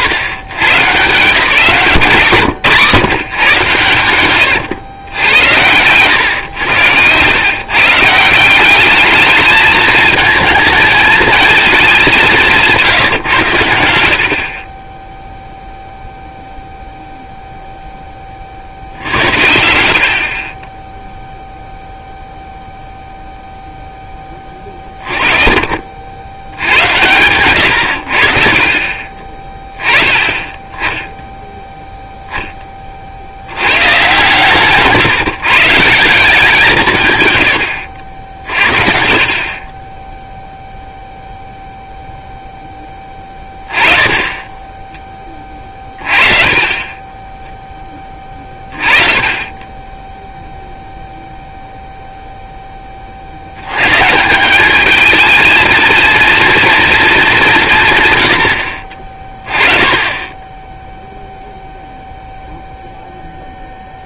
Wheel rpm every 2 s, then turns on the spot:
160, 150, 110, 100, 190, 220, 170, 30, 0, 60, 20, 0, 30, 80, 40, 0, 20, 130, 160, 50, 0, 10, 20, 30, 20, 0, 20, 210, 230, 70, 0, 0.
none